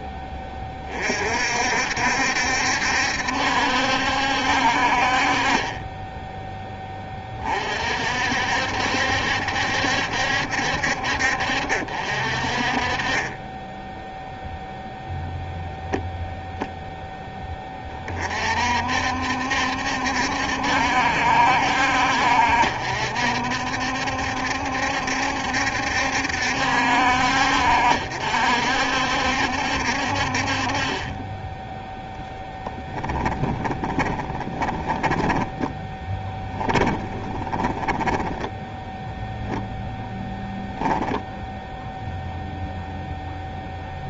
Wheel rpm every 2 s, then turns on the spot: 30, 70, 50, 20, 70, 60, 40, 0, 0, 60, 70, 60, 70, 60, 60, 20, 10, 10, 10, 0, 0, 0.
32-38